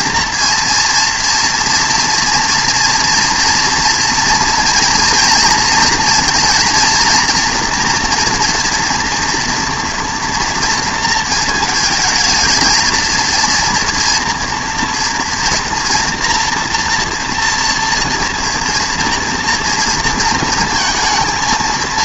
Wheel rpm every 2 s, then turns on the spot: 230, 240, 230, 230, 230, 230, 220, 240, 240, 230, 230.
none